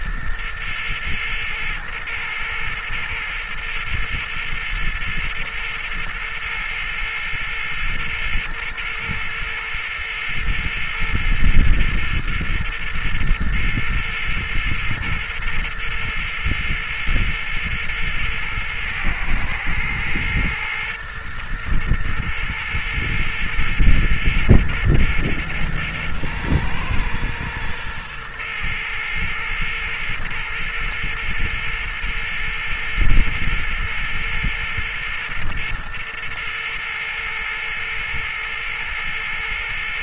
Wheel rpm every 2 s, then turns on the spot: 120, 120, 120, 120, 120, 120, 120, 120, 120, 120, 120, 120, 120, 120, 120, 120, 120, 120, 120, 120.
none